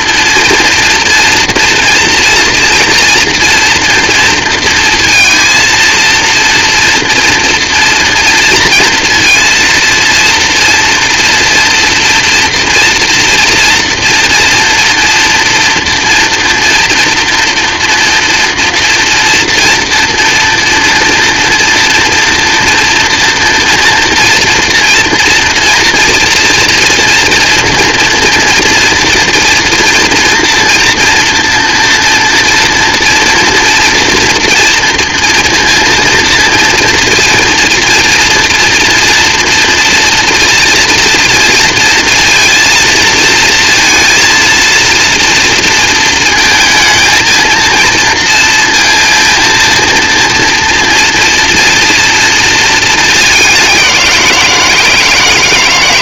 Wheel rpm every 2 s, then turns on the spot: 230, 230, 230, 240, 230, 230, 240, 240, 240, 230, 230, 230, 230, 230, 230, 230, 240, 230, 230, 230, 230, 230, 230, 220, 230, 240, 220, 160.
none